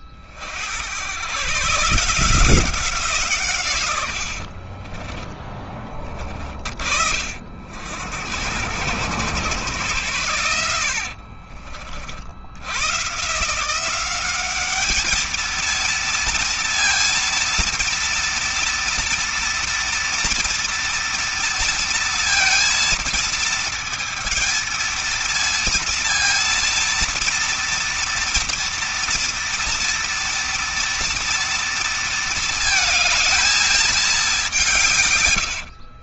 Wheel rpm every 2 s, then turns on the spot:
110, 160, 20, 50, 110, 70, 130, 220, 230, 230, 230, 230, 230, 230, 230, 230, 220, 140.
4-6 10-12